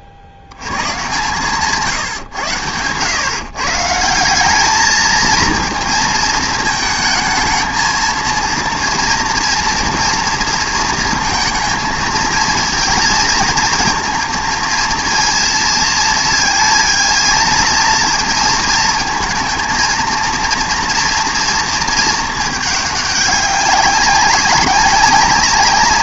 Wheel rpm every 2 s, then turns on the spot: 70, 100, 210, 230, 230, 230, 220, 230, 230, 230, 230, 210, 190.
none